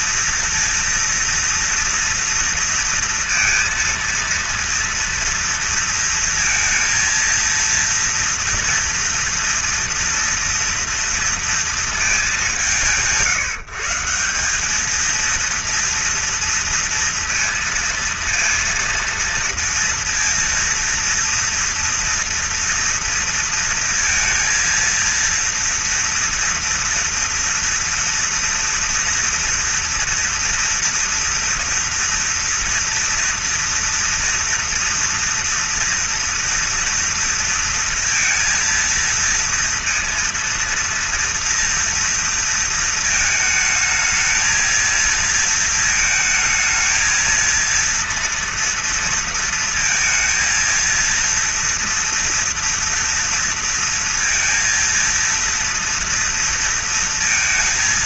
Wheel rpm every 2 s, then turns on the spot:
230, 230, 230, 230, 230, 230, 170, 210, 230, 230, 230, 230, 230, 230, 230, 230, 230, 230, 230, 230, 230, 220, 220, 220, 230, 230, 230, 230, 230.
none